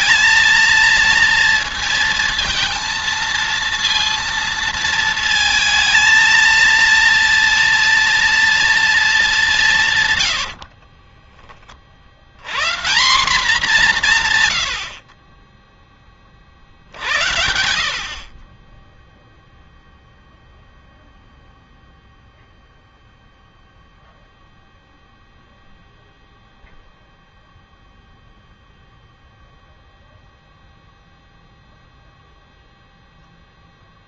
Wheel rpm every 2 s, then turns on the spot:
230, 230, 230, 230, 230, 40, 160, 80, 60, 10, 0, 0, 0, 0, 0, 0, 0.
10-12